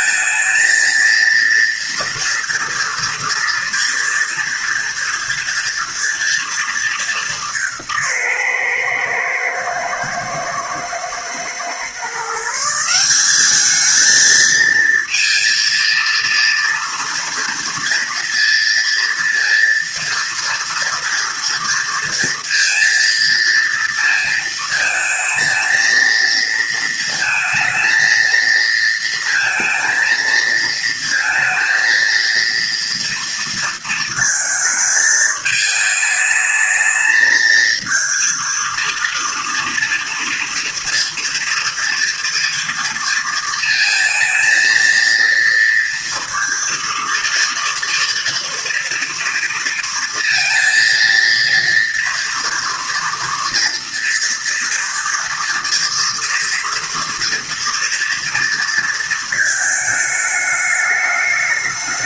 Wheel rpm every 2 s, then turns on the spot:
220, 230, 240, 220, 130, 110, 160, 230, 230, 230, 230, 230, 230, 230, 230, 230, 230, 220, 220, 230, 230, 230, 220, 230, 240, 230, 230, 230, 230, 230, 210.
none